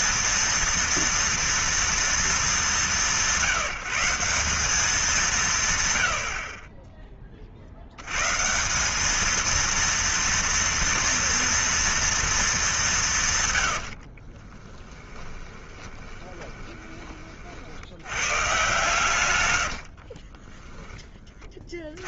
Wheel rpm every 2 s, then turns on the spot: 230, 200, 180, 50, 160, 230, 210, 40, 20, 130, 20.
14-18 20-22